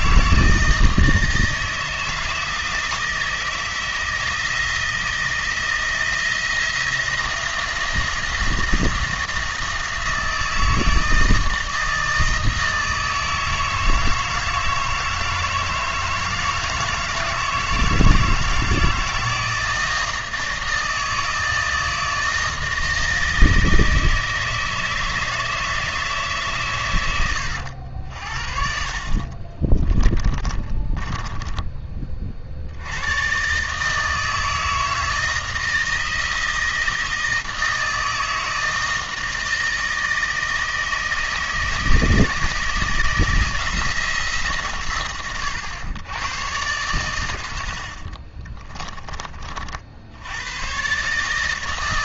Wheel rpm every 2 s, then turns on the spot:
160, 160, 160, 170, 170, 160, 160, 160, 160, 160, 160, 160, 160, 110, 50, 40, 90, 160, 160, 160, 160, 160, 130, 110, 30, 130.
30-32